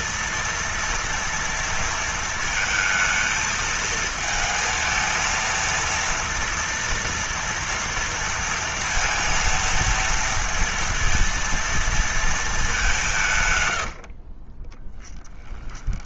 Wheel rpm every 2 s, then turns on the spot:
230, 230, 220, 230, 230, 230, 230, 70.
14-16